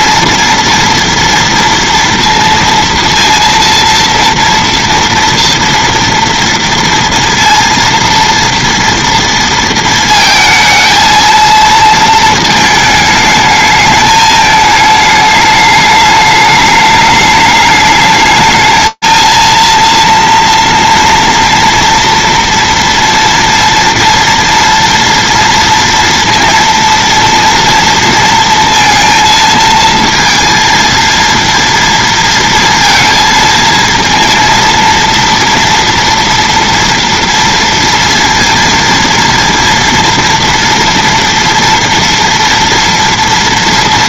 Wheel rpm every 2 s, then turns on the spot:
230, 230, 230, 230, 230, 230, 230, 220, 210, 210, 230, 230, 230, 230, 230, 230, 230, 230, 230, 230, 230, 230.
none